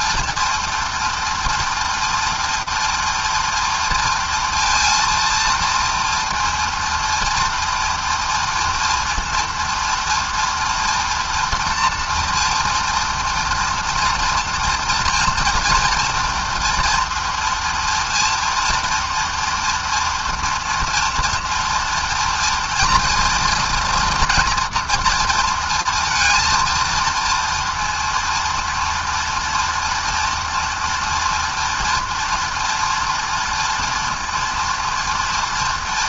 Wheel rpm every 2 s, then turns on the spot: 240, 230, 230, 230, 230, 230, 230, 230, 230, 230, 230, 230, 230, 230, 230, 230, 230, 230.
none